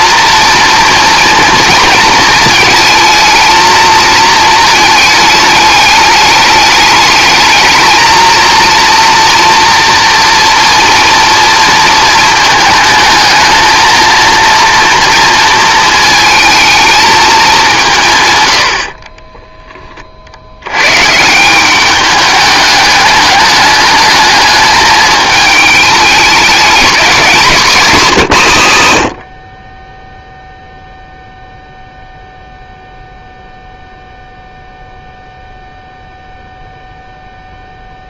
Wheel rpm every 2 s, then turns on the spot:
230, 220, 220, 210, 230, 230, 220, 230, 220, 80, 100, 210, 210, 210, 120, 0, 0, 0, 0.
none